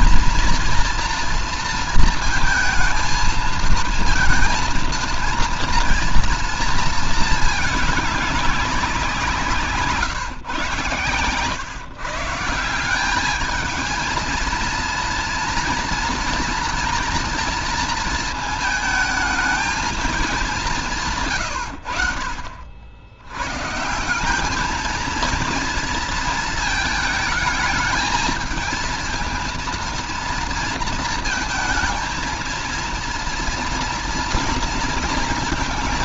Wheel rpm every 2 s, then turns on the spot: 230, 230, 230, 230, 200, 140, 170, 230, 230, 220, 190, 70, 200, 230, 220, 230, 230, 230.
none